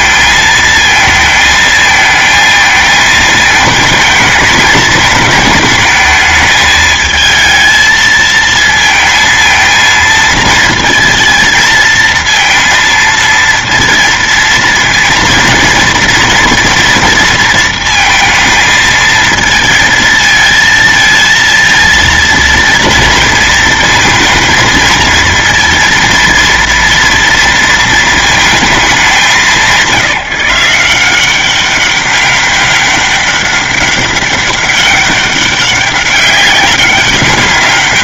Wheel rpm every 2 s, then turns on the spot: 230, 220, 220, 220, 220, 230, 230, 230, 230, 230, 230, 230, 230, 230, 220, 170, 200, 200, 200.
none